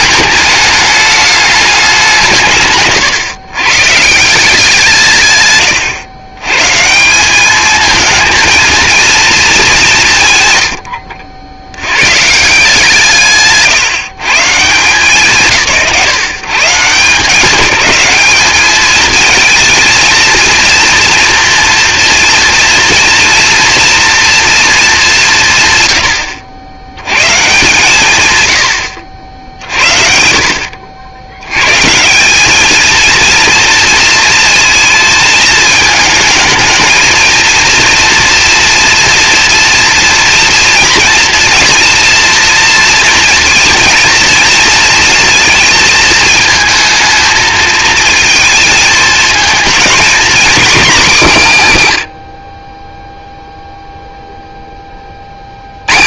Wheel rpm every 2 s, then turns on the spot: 210, 150, 170, 150, 230, 110, 170, 140, 160, 210, 230, 230, 220, 90, 90, 70, 220, 220, 220, 230, 230, 230, 230, 220, 220, 240, 20, 10.
none